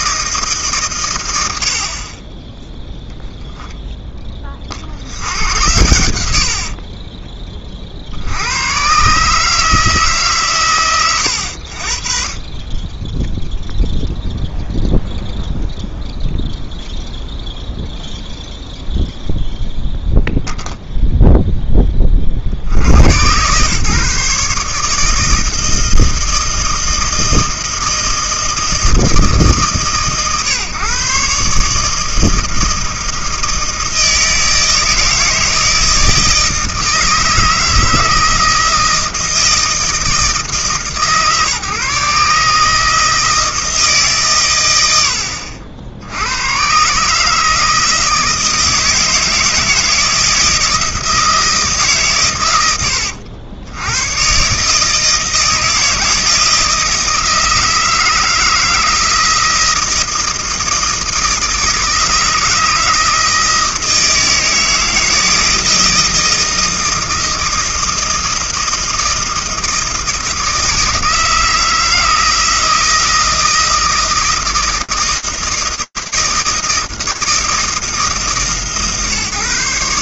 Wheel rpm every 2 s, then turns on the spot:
100, 0, 80, 20, 130, 110, 10, 0, 0, 0, 0, 70, 150, 160, 160, 130, 160, 160, 160, 160, 150, 160, 100, 120, 160, 160, 100, 140, 160, 160, 160, 160, 160, 160, 160, 160, 160, 160, 160, 140.
6-8